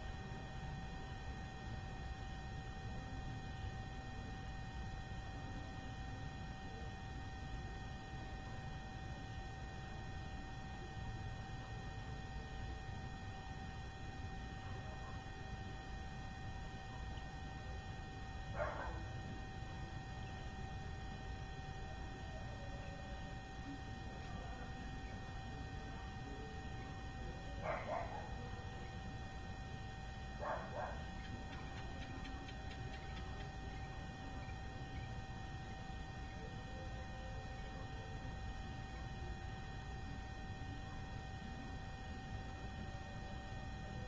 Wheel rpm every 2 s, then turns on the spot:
0, 0, 0, 0, 0, 0, 0, 0, 0, 0, 0, 0, 0, 0, 0, 0, 0, 0, 0, 0, 0, 0.
none